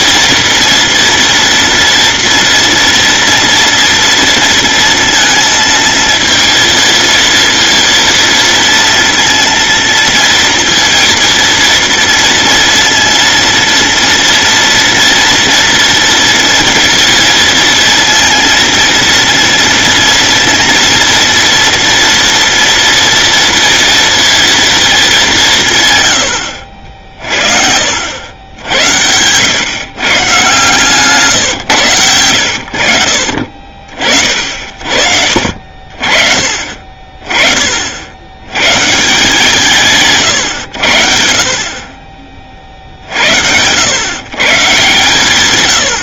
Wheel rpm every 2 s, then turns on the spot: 230, 230, 230, 230, 230, 230, 230, 240, 230, 230, 230, 230, 230, 80, 80, 140, 60, 60, 40, 120, 120, 40, 140.
none